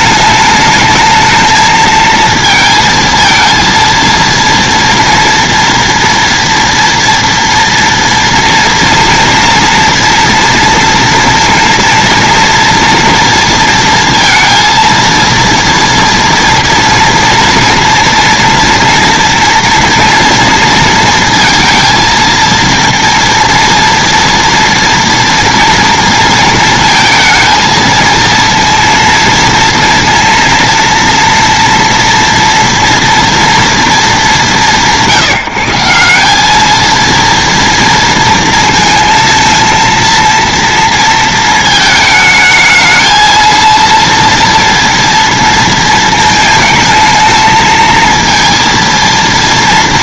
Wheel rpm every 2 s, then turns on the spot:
220, 230, 230, 230, 230, 230, 230, 230, 230, 240, 230, 230, 230, 230, 230, 230, 230, 160, 210, 230, 230, 220, 230, 220, 230.
none